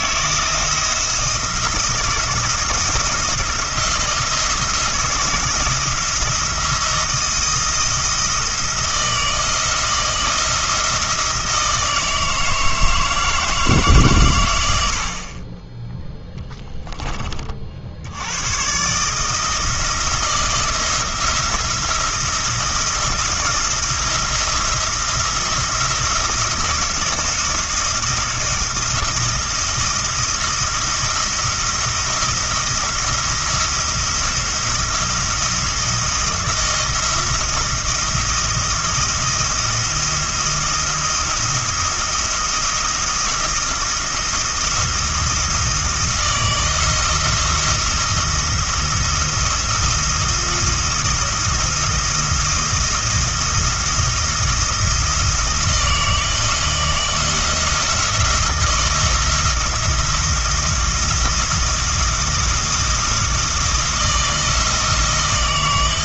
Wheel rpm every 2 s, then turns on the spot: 160, 170, 160, 170, 160, 170, 160, 80, 10, 130, 160, 170, 170, 170, 170, 170, 170, 170, 170, 170, 170, 170, 170, 170, 170, 170, 170, 170, 170, 170, 170, 170, 160.
none